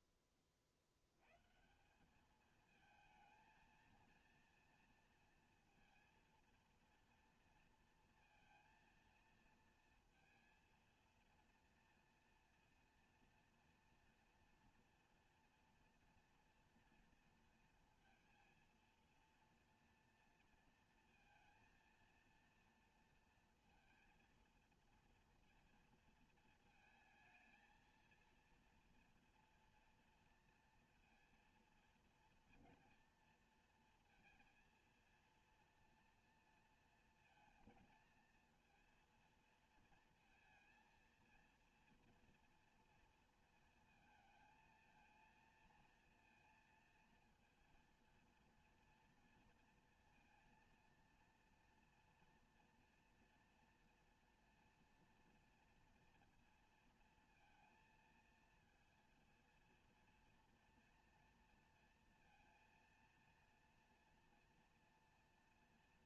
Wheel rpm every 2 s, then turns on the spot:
30, 220, 230, 230, 230, 230, 240, 240, 240, 230, 230, 230, 230, 230, 230, 230, 230, 230, 230, 230, 230, 240, 230, 230, 230, 230, 240, 230, 230, 230, 230, 230, 230.
none